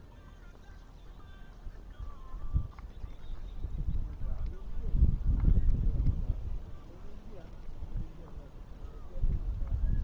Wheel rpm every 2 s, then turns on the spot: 0, 0, 0, 0, 0.
none